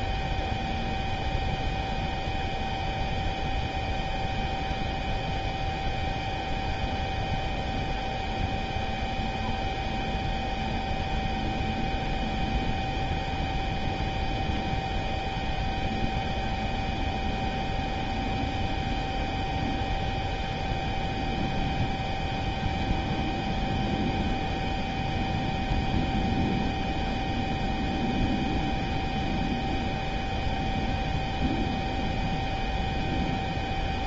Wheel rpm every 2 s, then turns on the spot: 0, 0, 0, 0, 0, 0, 0, 0, 0, 0, 0, 0, 0, 0, 0, 0, 0.
none